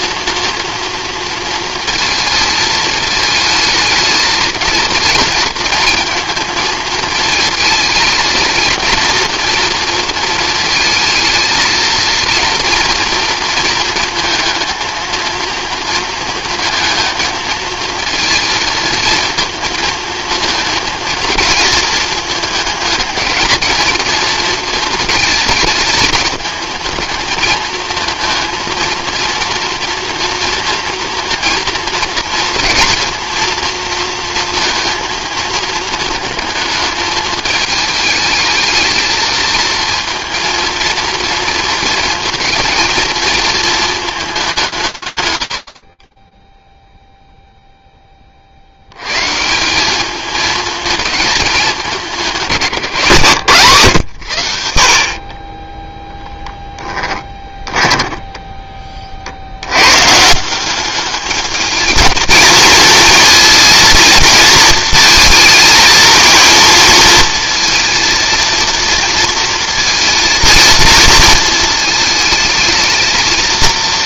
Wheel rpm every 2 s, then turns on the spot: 230, 220, 220, 220, 230, 230, 230, 220, 230, 220, 230, 220, 220, 220, 230, 230, 230, 230, 220, 220, 230, 220, 180, 0, 90, 210, 160, 60, 10, 20, 190, 220, 230, 230, 230, 220, 220.
56-58